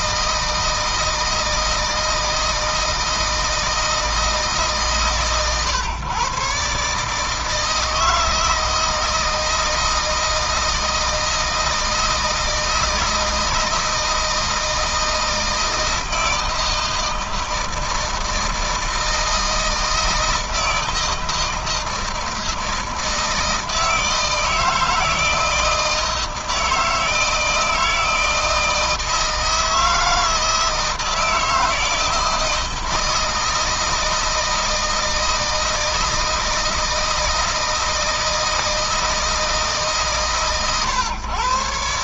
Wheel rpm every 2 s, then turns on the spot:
160, 160, 140, 150, 160, 160, 160, 160, 160, 160, 160, 160, 160, 160, 160, 160, 160, 160, 160, 160, 130.
none